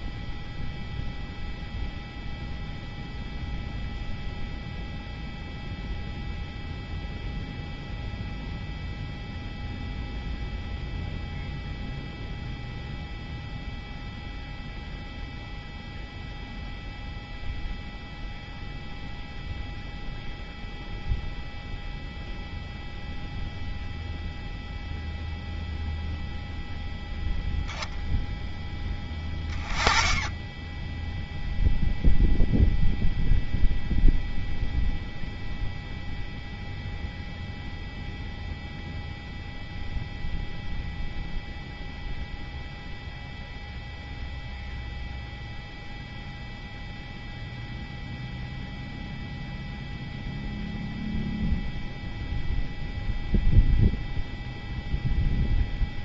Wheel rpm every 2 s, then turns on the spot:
0, 0, 0, 0, 0, 0, 0, 0, 0, 0, 0, 0, 0, 0, 10, 0, 0, 0, 0, 0, 0, 0, 0, 0, 0, 0, 0, 0.
none